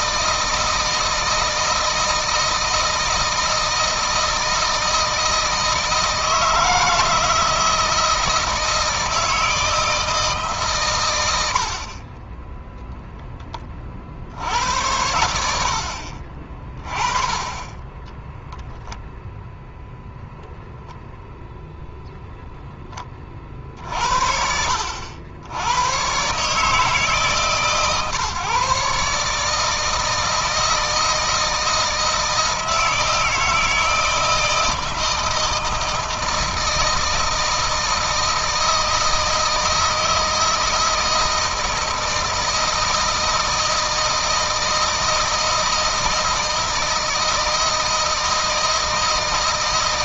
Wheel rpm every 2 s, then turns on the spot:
160, 160, 160, 160, 160, 120, 0, 80, 30, 0, 0, 10, 70, 150, 140, 160, 160, 160, 160, 160, 160, 160, 160, 160, 160.
none